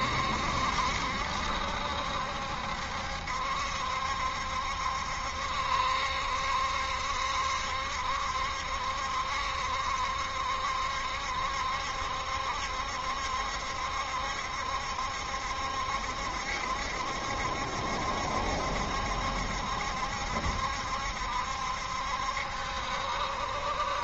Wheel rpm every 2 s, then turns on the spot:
70, 70, 70, 70, 70, 70, 70, 70, 70, 70, 70, 70.
none